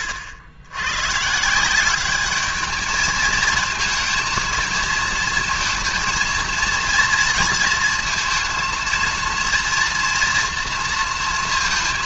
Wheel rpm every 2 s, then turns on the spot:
100, 210, 220, 230, 220, 230.
none